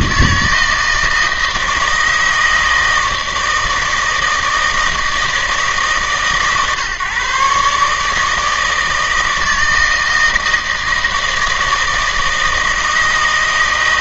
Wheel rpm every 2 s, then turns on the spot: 160, 160, 160, 140, 160, 160, 160.
none